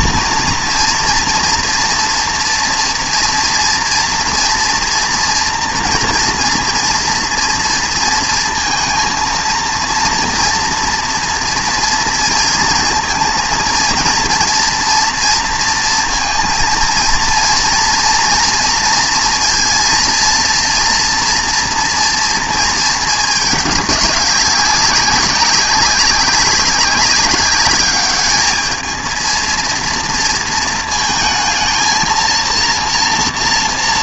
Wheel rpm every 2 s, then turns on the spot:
230, 230, 230, 240, 230, 230, 230, 230, 230, 240, 230, 230, 200, 200, 210, 230, 230.
none